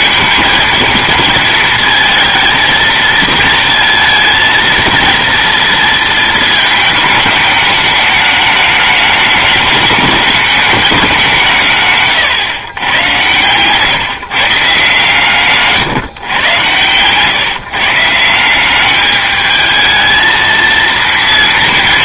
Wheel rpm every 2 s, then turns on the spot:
230, 230, 230, 220, 210, 210, 110, 150, 110, 190, 230.
none